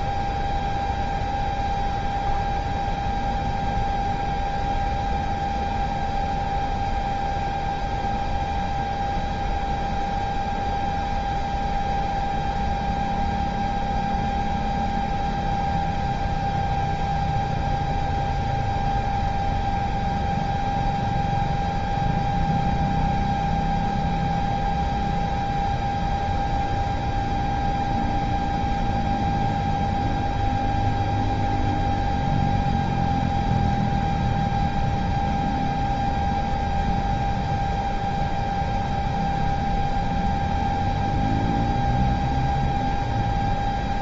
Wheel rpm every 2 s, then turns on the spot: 0, 0, 0, 0, 0, 0, 0, 0, 0, 0, 0, 0, 0, 0, 0, 0, 0, 0, 0, 0, 0, 0.
none